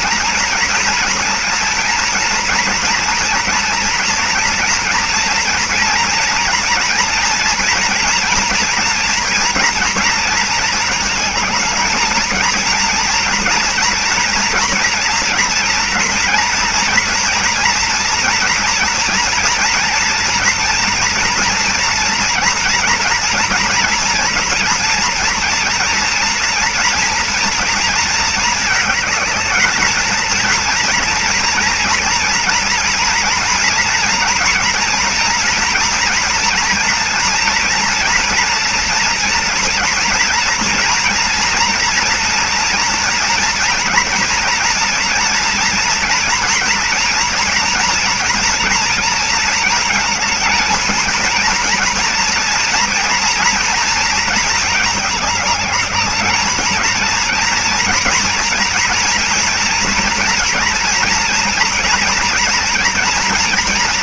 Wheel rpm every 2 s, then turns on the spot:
240, 230, 230, 230, 230, 230, 220, 240, 240, 240, 240, 230, 230, 230, 220, 230, 230, 230, 230, 230, 230, 240, 230, 230, 230, 220, 230, 220, 210, 230, 240, 240.
none